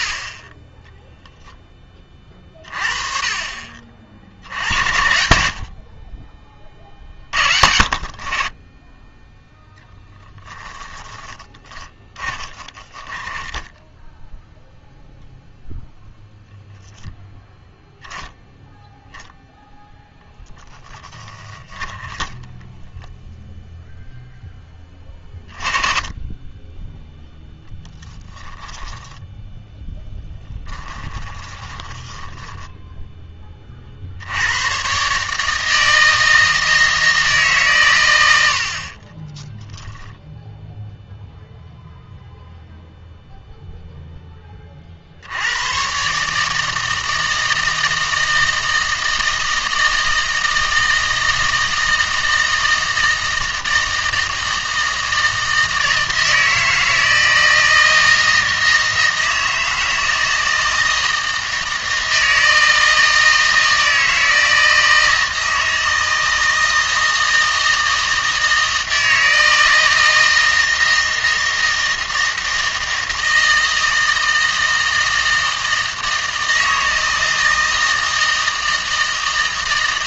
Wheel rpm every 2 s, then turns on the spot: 10, 30, 80, 30, 30, 20, 10, 0, 0, 0, 10, 0, 10, 10, 10, 10, 10, 110, 160, 70, 10, 0, 30, 160, 160, 160, 160, 160, 160, 160, 160, 160, 160, 160, 160, 160, 160, 160, 160, 160.
10-14 28-34